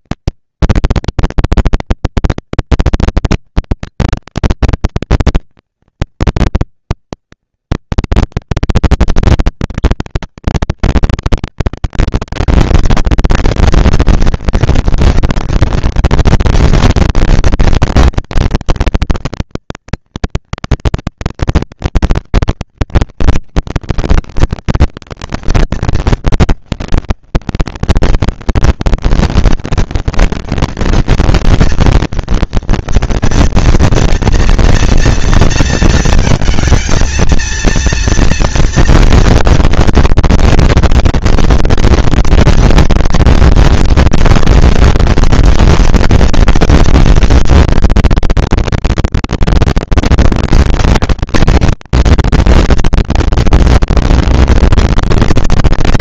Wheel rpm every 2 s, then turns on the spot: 230, 230, 230, 230, 240, 220, 230, 230, 220, 230, 230, 230, 230, 210, 190, 220, 230, 230, 220, 230, 230, 230, 230, 240, 240, 230, 230, 230.
none